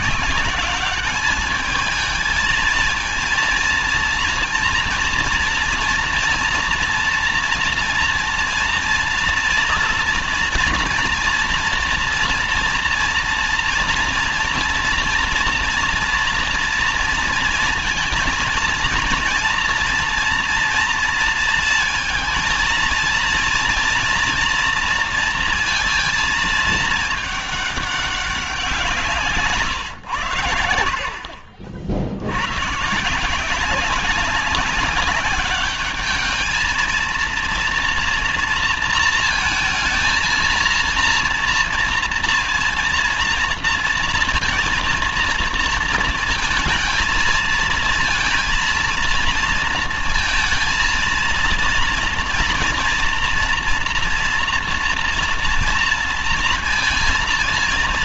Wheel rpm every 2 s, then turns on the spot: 190, 220, 230, 230, 230, 240, 230, 240, 230, 230, 230, 230, 230, 220, 190, 90, 110, 190, 220, 230, 230, 230, 230, 220, 230, 230, 230, 240, 230.
none